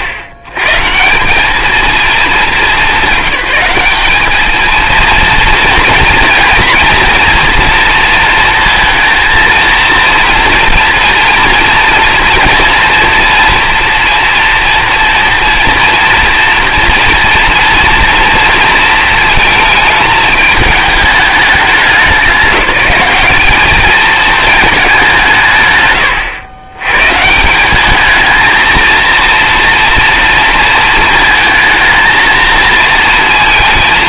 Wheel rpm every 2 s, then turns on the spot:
120, 210, 220, 230, 230, 230, 230, 240, 230, 230, 220, 190, 210, 120, 230, 230, 230.
none